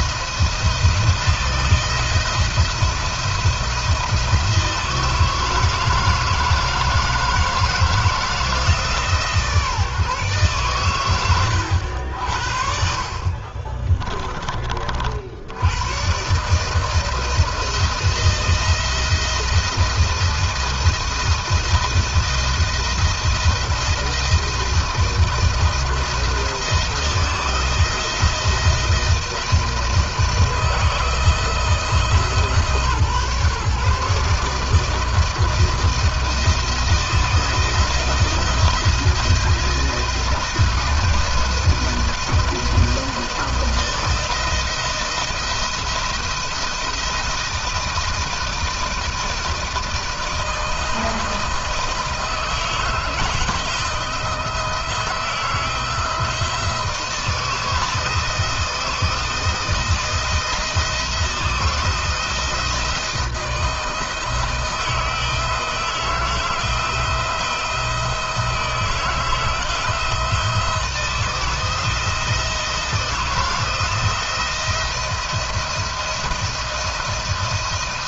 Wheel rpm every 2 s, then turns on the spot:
170, 170, 170, 160, 160, 120, 60, 50, 160, 160, 170, 170, 170, 170, 170, 160, 140, 160, 170, 160, 170, 160, 170, 170, 160, 160, 160, 160, 160, 160, 170, 160, 160, 160, 160, 160, 170, 170, 160.
12-14